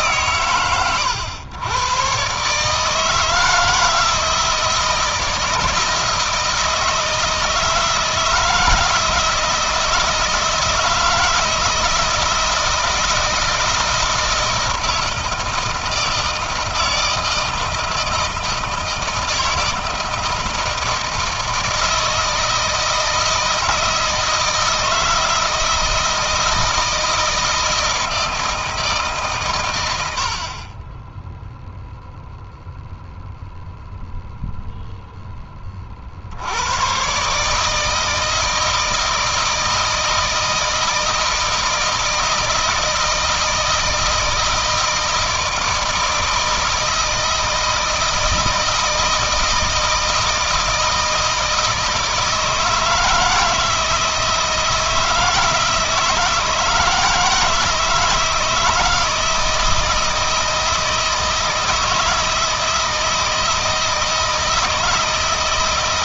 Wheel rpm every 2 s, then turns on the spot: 110, 150, 160, 160, 160, 160, 160, 160, 160, 160, 160, 160, 160, 160, 160, 20, 0, 0, 120, 160, 160, 160, 160, 160, 160, 160, 160, 160, 160, 160, 160, 160, 160.
none